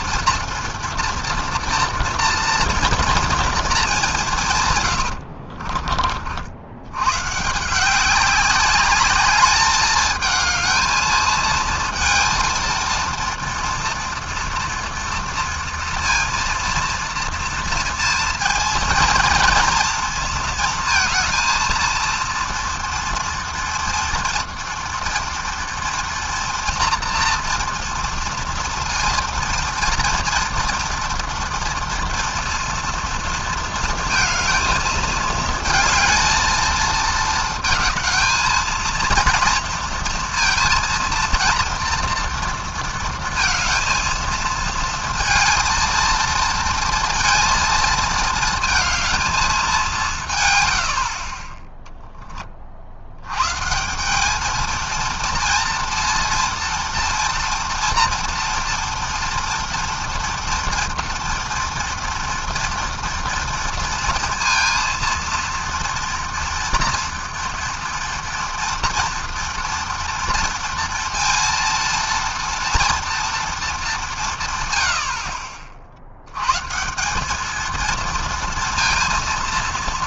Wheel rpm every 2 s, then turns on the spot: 230, 230, 80, 130, 210, 220, 230, 230, 230, 230, 230, 230, 230, 240, 230, 230, 230, 220, 220, 230, 230, 230, 220, 230, 220, 30, 100, 230, 230, 230, 230, 230, 230, 230, 230, 230, 230, 50, 200, 230.
4-6